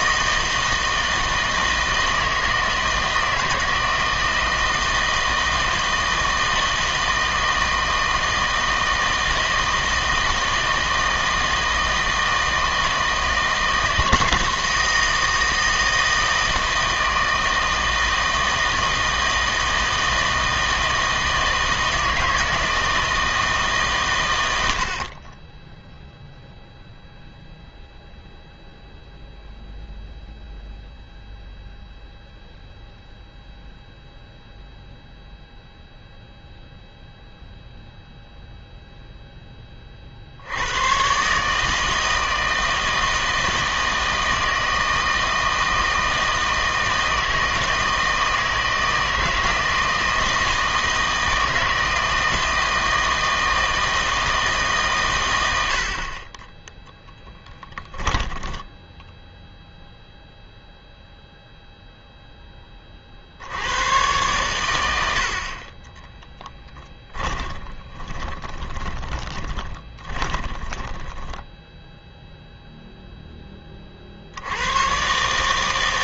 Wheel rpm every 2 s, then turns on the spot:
160, 160, 160, 160, 160, 160, 160, 160, 160, 160, 160, 160, 130, 0, 0, 0, 0, 0, 0, 0, 80, 160, 160, 160, 160, 160, 160, 150, 10, 10, 0, 10, 110, 10, 20, 10, 0, 90.
58-60 66-72